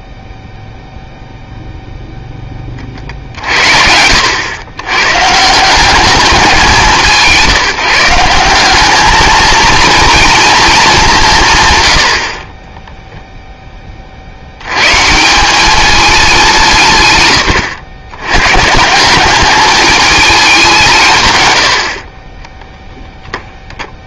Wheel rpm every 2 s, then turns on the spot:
0, 40, 120, 170, 210, 200, 0, 150, 130, 170, 160, 10.
none